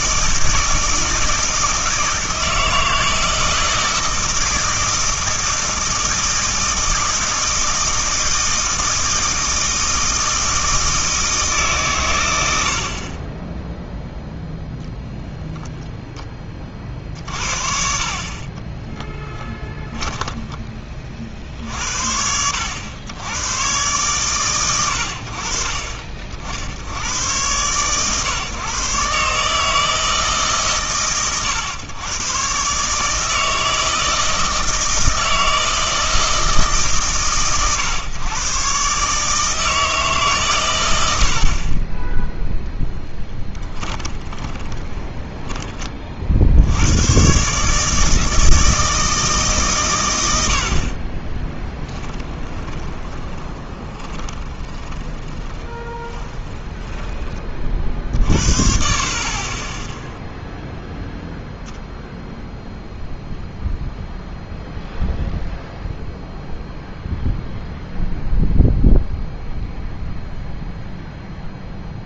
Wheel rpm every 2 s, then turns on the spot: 160, 160, 160, 160, 160, 160, 80, 0, 30, 20, 20, 90, 100, 70, 120, 140, 140, 160, 150, 130, 120, 0, 30, 90, 160, 70, 20, 20, 20, 50, 0, 0, 0, 0, 0, 0.
18-20 44-46 52-58